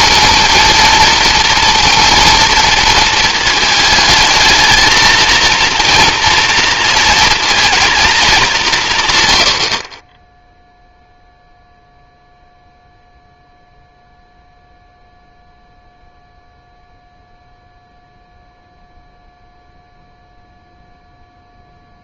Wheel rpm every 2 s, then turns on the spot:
230, 230, 220, 230, 220, 10, 0, 0, 0, 0, 0.
none